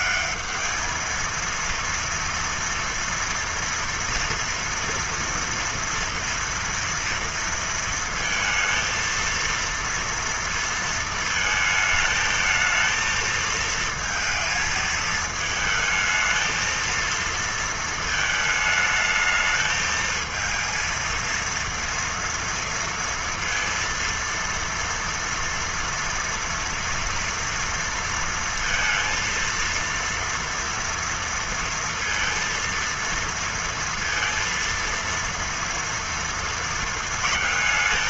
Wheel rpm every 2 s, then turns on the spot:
210, 230, 240, 230, 230, 230, 220, 220, 220, 220, 220, 230, 230, 230, 230, 230, 230, 230, 230.
none